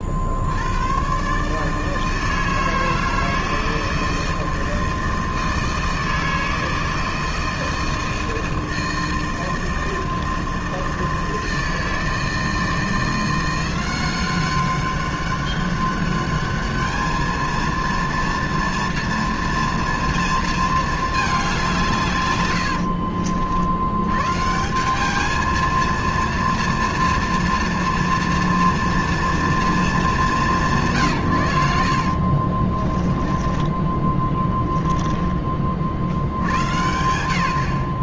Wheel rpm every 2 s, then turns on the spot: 100, 160, 160, 160, 160, 160, 170, 200, 210, 230, 220, 80, 190, 230, 230, 140, 20, 10, 100.
22-24 32-36